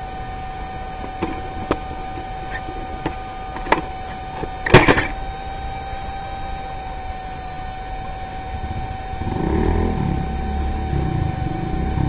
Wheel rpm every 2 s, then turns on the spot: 0, 0, 0, 0, 0, 0.
none